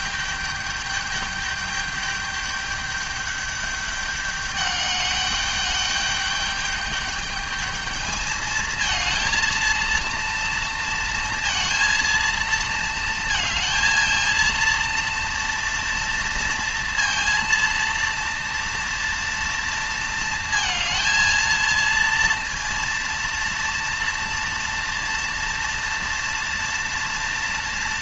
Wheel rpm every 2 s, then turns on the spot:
210, 210, 200, 210, 220, 230, 230, 230, 230, 230, 230, 230, 230, 230.
none